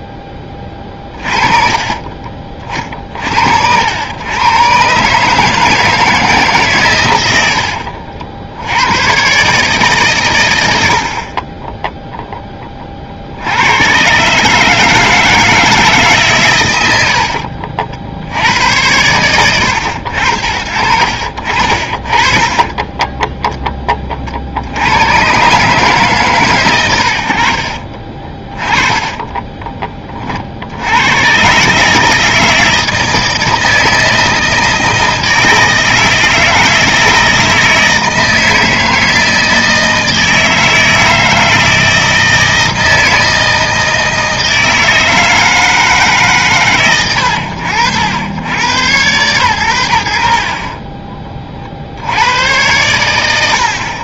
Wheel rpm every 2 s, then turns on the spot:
20, 30, 120, 140, 80, 90, 20, 150, 110, 90, 60, 30, 80, 110, 20, 70, 160, 160, 160, 160, 160, 160, 160, 110, 100, 10, 110.
0-2 22-24 28-30